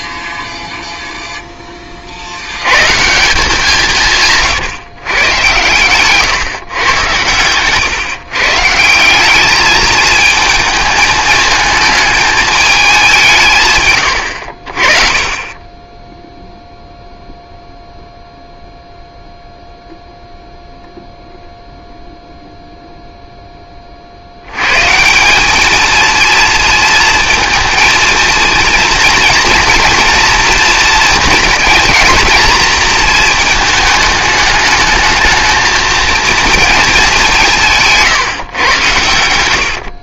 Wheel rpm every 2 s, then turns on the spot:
0, 110, 150, 130, 160, 220, 210, 40, 0, 0, 0, 0, 110, 230, 230, 230, 230, 210, 220, 110.
none